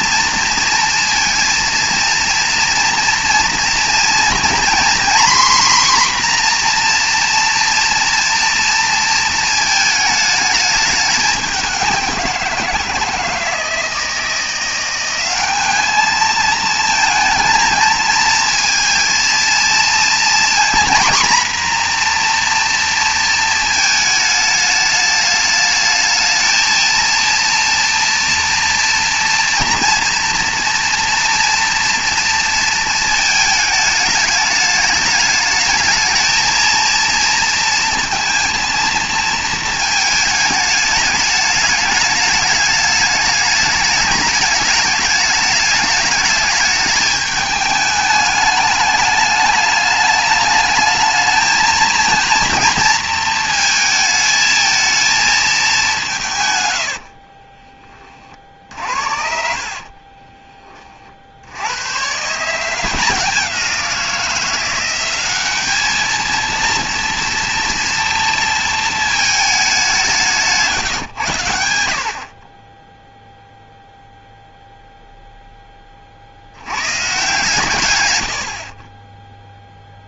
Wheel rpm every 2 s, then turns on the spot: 230, 230, 250, 250, 230, 210, 170, 170, 220, 220, 230, 240, 210, 220, 230, 230, 230, 210, 230, 230, 210, 210, 210, 210, 210, 210, 230, 220, 90, 50, 30, 160, 180, 230, 230, 160, 20, 0, 100, 40.
56-60